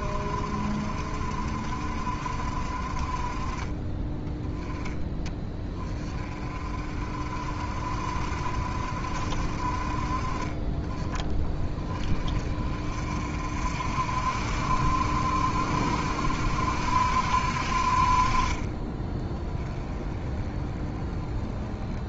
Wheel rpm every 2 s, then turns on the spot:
50, 30, 10, 40, 50, 20, 40, 60, 70, 30, 20.
none